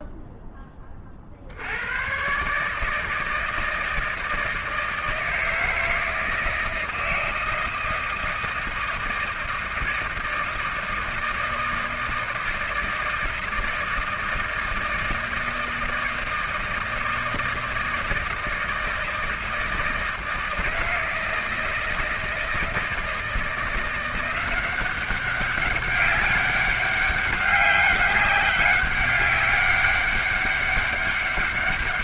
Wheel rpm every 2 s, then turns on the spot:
20, 150, 160, 160, 160, 160, 170, 160, 160, 160, 160, 170, 190, 200, 200, 200.
none